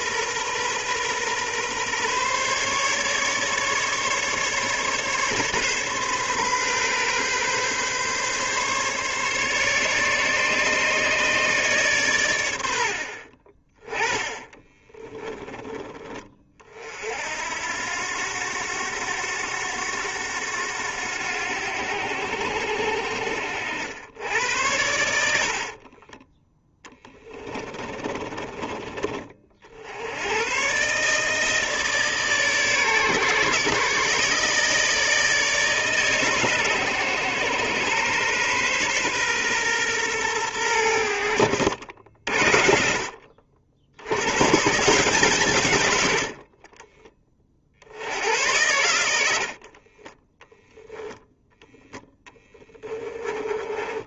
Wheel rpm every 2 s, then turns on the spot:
130, 140, 140, 130, 140, 150, 90, 10, 50, 100, 90, 70, 80, 10, 30, 130, 140, 150, 130, 130, 90, 60, 160, 30, 100, 0, 20.
14-16 26-28